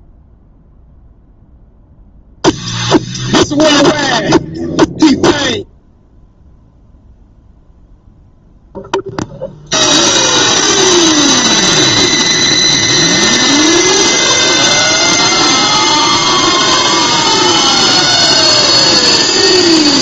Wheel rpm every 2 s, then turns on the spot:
0, 0, 0, 0, 0, 0, 0, 0, 0, 0.
none